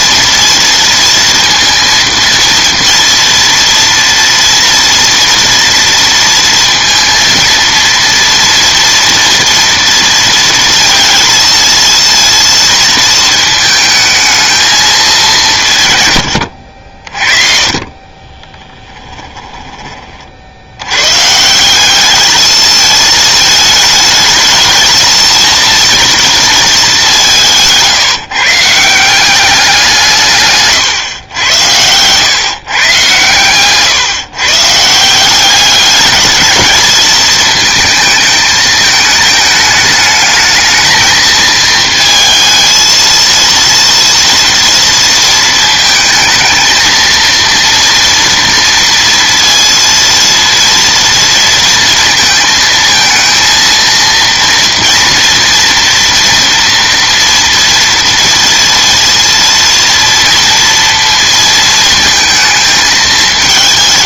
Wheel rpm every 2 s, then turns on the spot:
230, 230, 240, 230, 230, 230, 230, 220, 70, 10, 70, 210, 220, 210, 150, 130, 130, 140, 220, 220, 220, 230, 230, 230, 230, 230, 230, 230, 240, 230, 230, 220.
18-20 30-32